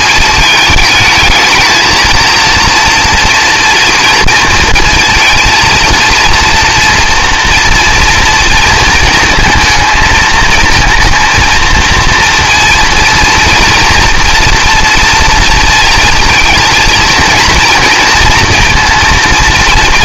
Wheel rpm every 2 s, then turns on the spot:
220, 230, 230, 230, 230, 230, 230, 240, 230, 230.
none